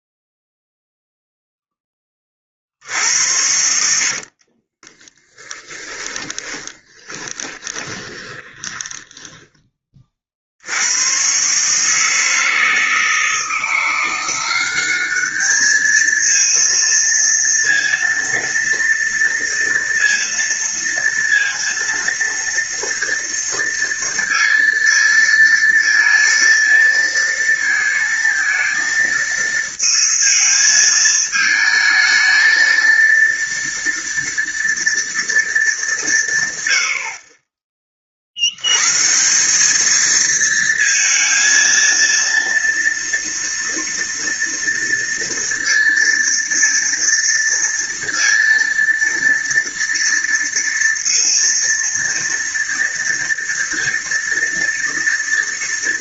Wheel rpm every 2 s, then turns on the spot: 0, 30, 50, 10, 20, 50, 160, 180, 230, 230, 230, 230, 230, 230, 230, 220, 220, 230, 150, 70, 220, 230, 230, 230, 230, 230, 230, 230.
4-10